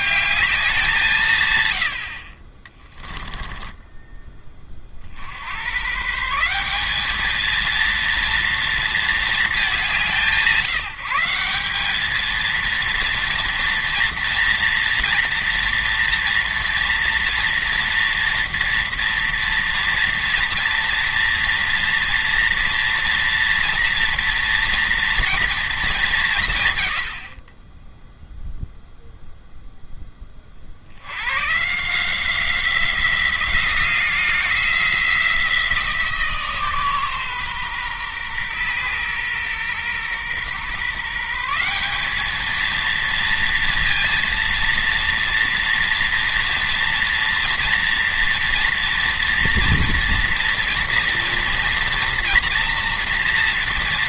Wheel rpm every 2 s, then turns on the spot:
180, 20, 40, 200, 230, 170, 230, 240, 230, 230, 230, 240, 230, 110, 0, 60, 180, 170, 140, 120, 140, 230, 230, 230, 240, 230, 230.
2-4